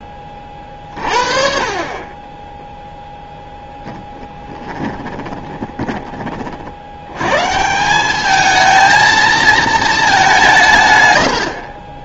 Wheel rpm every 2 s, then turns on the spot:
40, 0, 10, 60, 220, 160.
4-6